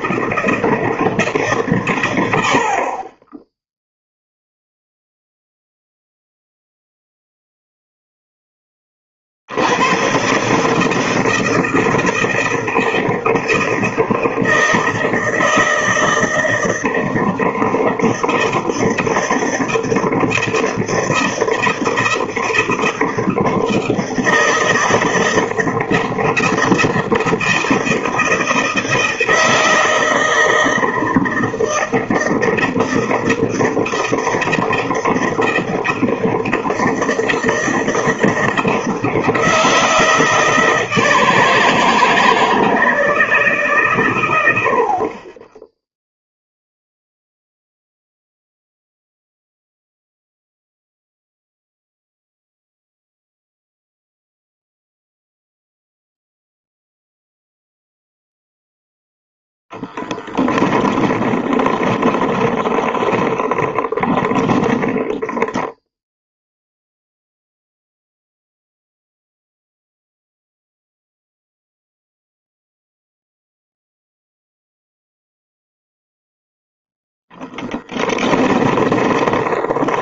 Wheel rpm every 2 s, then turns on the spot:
160, 60, 0, 0, 20, 150, 160, 160, 160, 160, 160, 160, 160, 160, 160, 160, 160, 160, 160, 160, 160, 160, 70, 0, 0, 0, 0, 0, 0, 0, 10, 30, 10, 0, 0, 0, 0, 0, 0, 30.
60-66 78-80